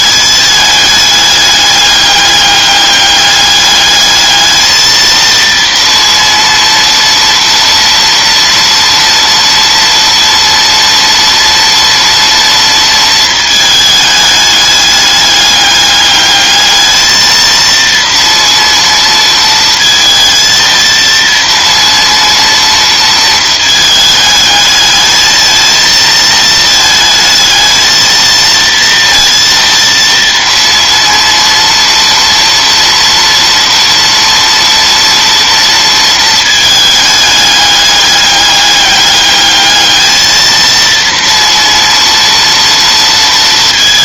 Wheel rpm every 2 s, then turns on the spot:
210, 200, 220, 230, 230, 230, 230, 210, 220, 230, 230, 230, 220, 220, 230, 230, 230, 230, 220, 200, 230, 230.
none